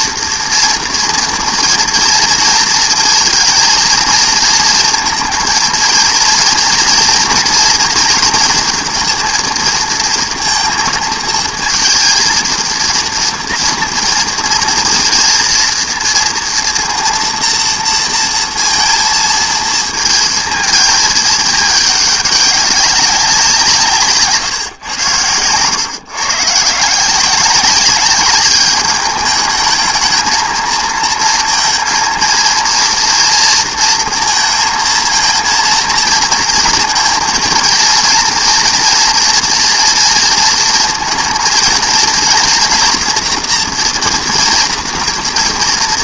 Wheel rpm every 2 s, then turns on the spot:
230, 230, 220, 230, 230, 220, 230, 230, 230, 230, 230, 200, 150, 130, 200, 220, 230, 230, 230, 230, 230, 230, 230.
none